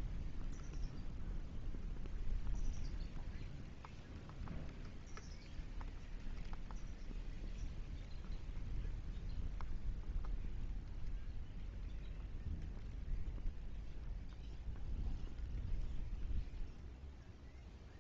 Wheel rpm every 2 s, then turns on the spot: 0, 0, 0, 0, 0, 0, 0, 0, 0.
none